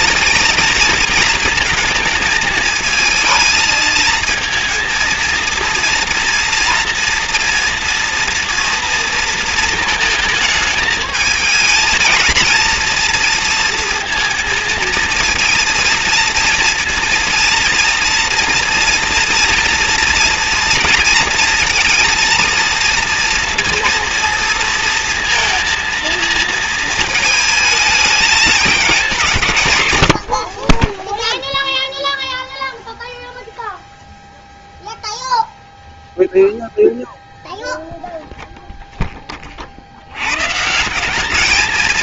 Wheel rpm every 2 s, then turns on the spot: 220, 220, 230, 240, 230, 220, 230, 230, 230, 230, 230, 230, 240, 220, 210, 50, 0, 0, 0, 0, 130.
none